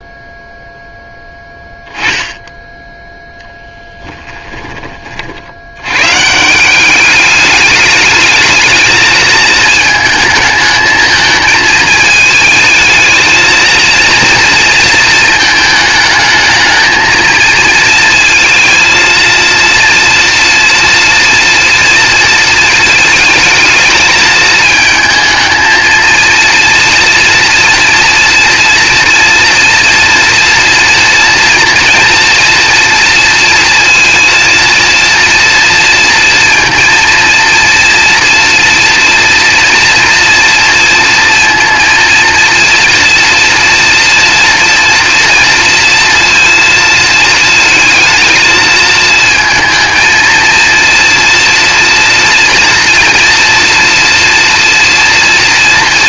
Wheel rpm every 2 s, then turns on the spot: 0, 10, 30, 190, 220, 220, 220, 230, 220, 230, 240, 220, 220, 230, 230, 230, 240, 230, 230, 230, 230, 230, 230, 220, 220, 230, 230, 230.
none